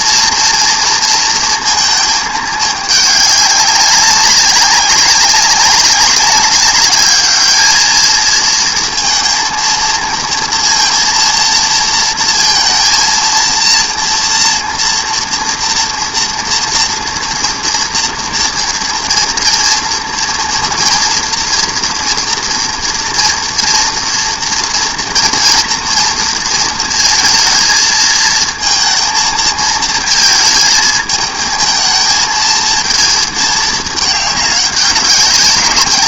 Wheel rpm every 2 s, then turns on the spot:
230, 210, 200, 200, 220, 230, 230, 230, 230, 230, 240, 230, 230, 230, 230, 220, 220, 200.
none